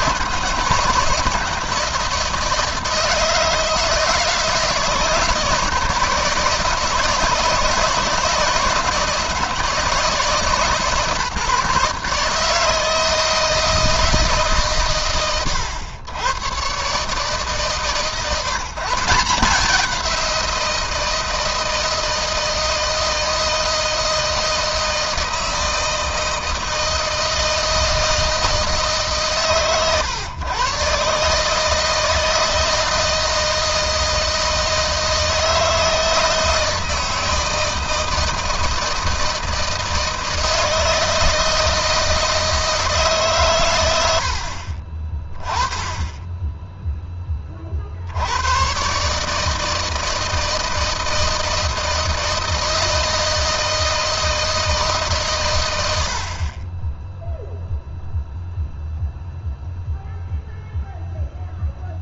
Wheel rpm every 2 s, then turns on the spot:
150, 160, 160, 160, 160, 150, 160, 120, 130, 150, 170, 160, 160, 160, 160, 140, 160, 160, 160, 160, 160, 150, 20, 10, 130, 160, 160, 140, 10, 0, 0.
none